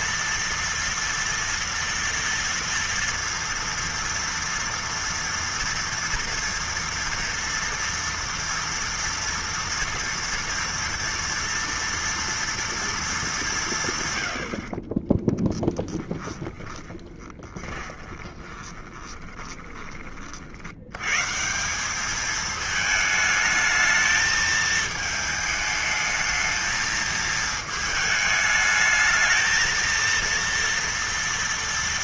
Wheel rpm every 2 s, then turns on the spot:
230, 230, 230, 230, 230, 240, 230, 80, 10, 20, 60, 220, 220, 220, 220, 230.
16-20